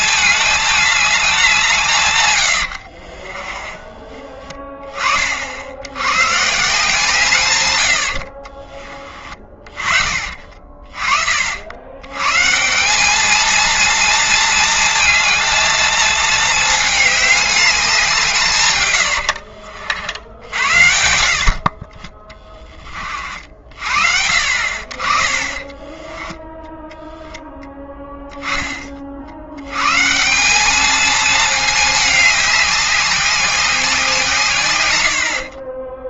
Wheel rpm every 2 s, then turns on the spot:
210, 50, 30, 150, 30, 40, 200, 230, 210, 100, 60, 40, 40, 0, 50, 220, 190, 100.
2-4 18-20